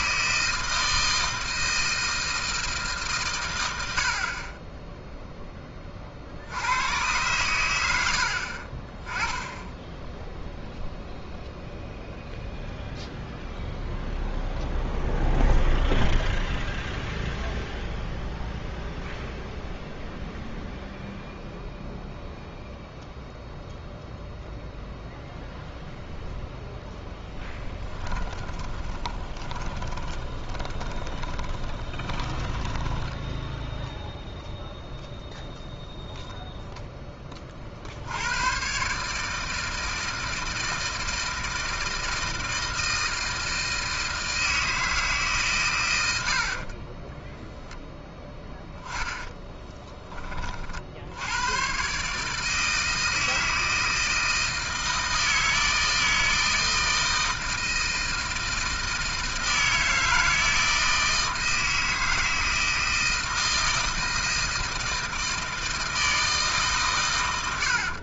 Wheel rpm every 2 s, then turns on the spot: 160, 160, 20, 80, 40, 0, 0, 0, 0, 0, 0, 0, 0, 0, 20, 20, 10, 0, 0, 110, 160, 160, 160, 50, 10, 40, 160, 160, 160, 160, 160, 160, 160, 150.
28-34